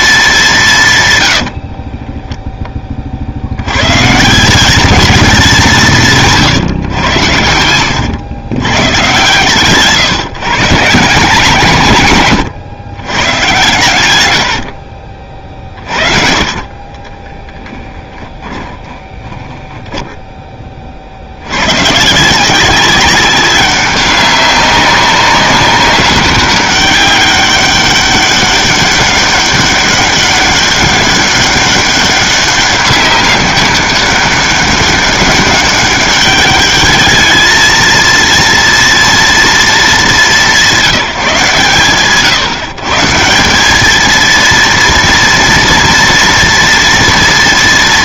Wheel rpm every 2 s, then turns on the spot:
170, 10, 200, 140, 110, 150, 110, 80, 30, 10, 20, 180, 200, 200, 200, 200, 200, 200, 210, 230, 190, 140, 230, 230.
6-8 14-20